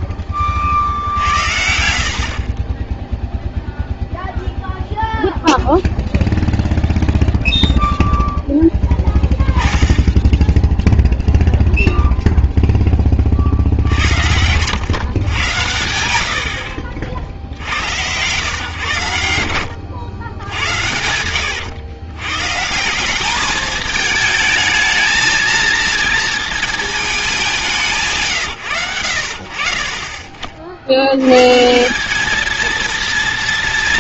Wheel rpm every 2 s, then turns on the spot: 60, 20, 0, 0, 10, 10, 10, 110, 60, 120, 90, 170, 220, 220, 110, 60, 230.
0-4